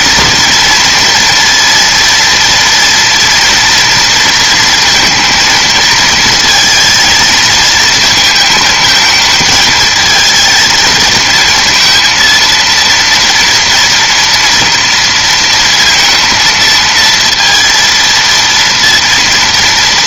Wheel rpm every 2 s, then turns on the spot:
230, 230, 230, 220, 220, 230, 230, 230, 230, 230.
none